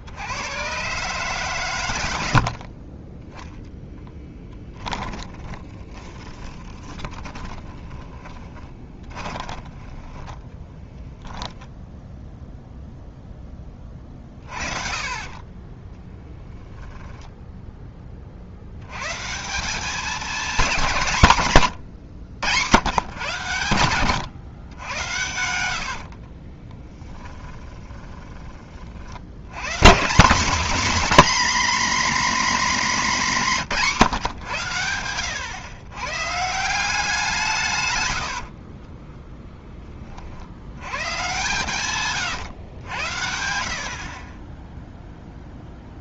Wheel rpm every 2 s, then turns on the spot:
120, 50, 10, 20, 20, 10, 0, 40, 10, 90, 190, 120, 100, 10, 40, 250, 250, 110, 180, 20, 100, 100, 10.
4-12 16-18 24-28 38-40